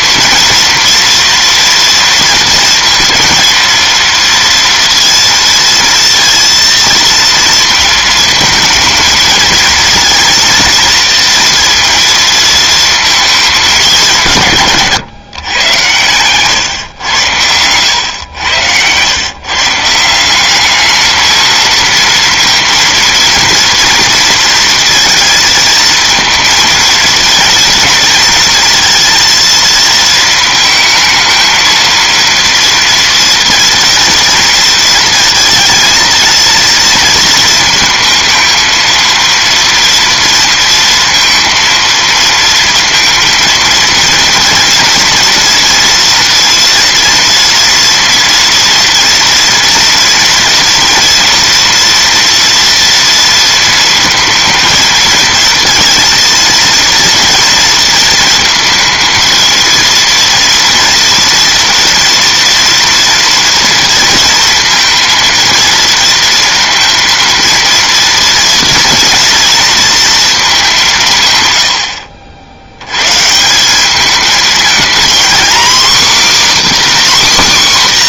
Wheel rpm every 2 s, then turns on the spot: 230, 230, 230, 230, 220, 230, 230, 150, 130, 90, 210, 230, 230, 230, 230, 220, 230, 230, 230, 230, 230, 230, 230, 240, 240, 230, 230, 220, 230, 230, 230, 230, 230, 230, 230, 190, 80, 220, 280.
16-18